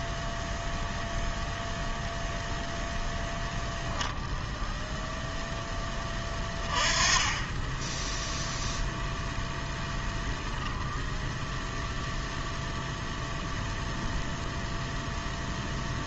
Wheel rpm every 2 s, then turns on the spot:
0, 0, 0, 20, 0, 0, 0, 0.
none